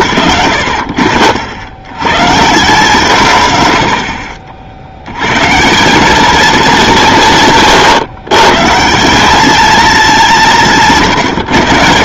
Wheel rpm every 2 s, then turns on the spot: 110, 150, 60, 210, 130, 170.
none